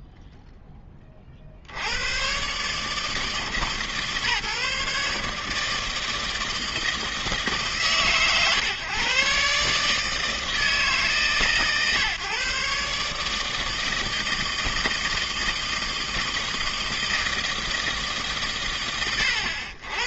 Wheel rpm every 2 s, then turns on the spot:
0, 130, 150, 160, 120, 160, 130, 160, 160, 150.
none